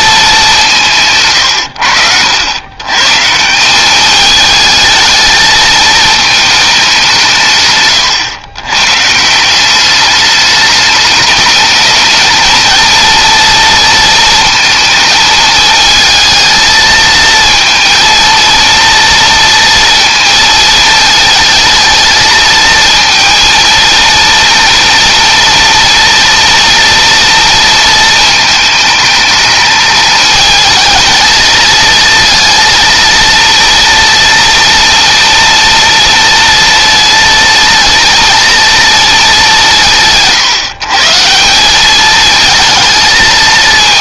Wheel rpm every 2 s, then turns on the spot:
180, 100, 210, 210, 120, 210, 220, 220, 220, 230, 230, 230, 230, 230, 220, 220, 230, 230, 230, 230, 160, 220.
none